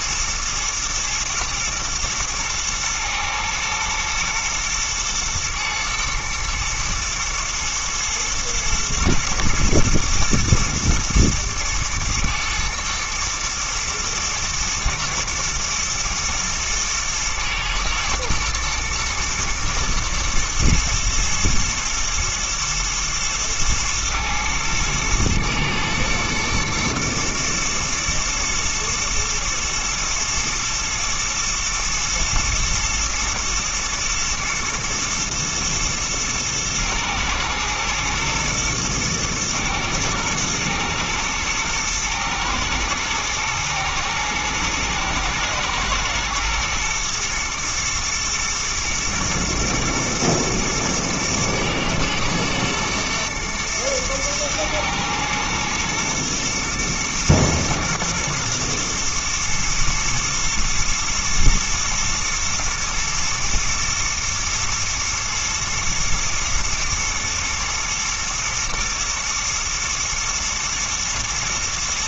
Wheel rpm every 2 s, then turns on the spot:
120, 120, 110, 120, 120, 120, 110, 110, 110, 110, 110, 120, 110, 110, 110, 110, 110, 110, 110, 110, 110, 110, 110, 120, 120, 120, 120, 110, 110, 120, 110, 110, 120, 110, 110, 120.
none